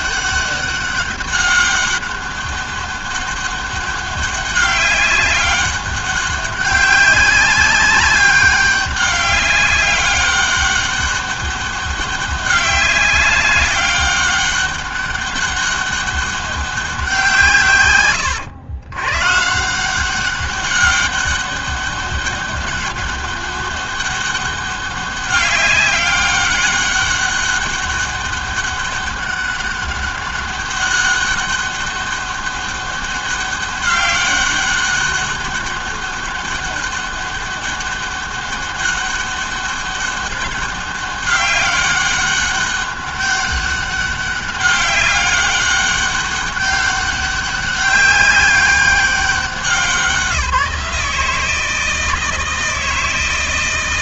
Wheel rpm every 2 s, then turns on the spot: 200, 200, 200, 200, 200, 200, 190, 200, 190, 110, 200, 200, 200, 200, 190, 200, 200, 200, 200, 200, 200, 200, 200, 200, 190, 180, 160.
none